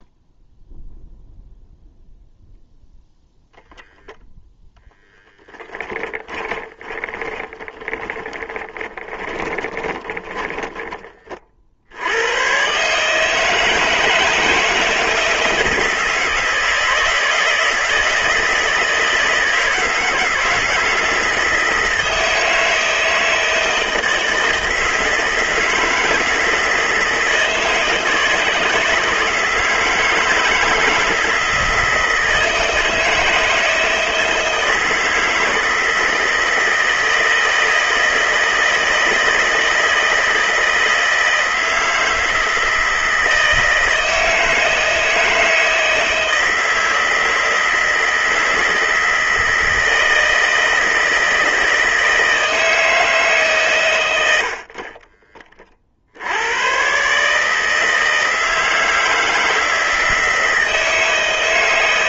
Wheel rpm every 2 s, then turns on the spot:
0, 0, 0, 10, 30, 10, 120, 160, 160, 160, 160, 160, 160, 160, 160, 160, 160, 160, 160, 160, 160, 160, 160, 160, 160, 160, 160, 70, 90, 160, 160.
6-12 54-56